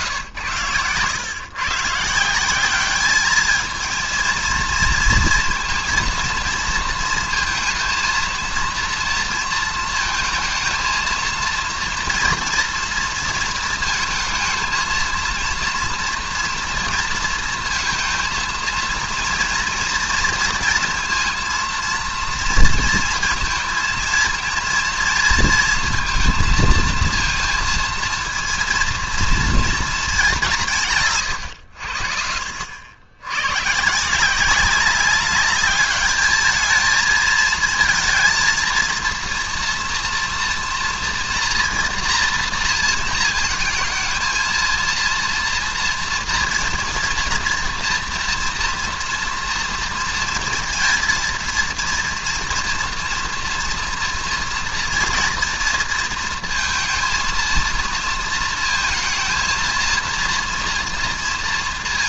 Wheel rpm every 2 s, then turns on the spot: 120, 190, 230, 230, 230, 230, 230, 220, 230, 230, 230, 230, 230, 230, 230, 170, 70, 190, 220, 230, 230, 230, 230, 230, 230, 230, 240, 230, 230, 220, 230.
none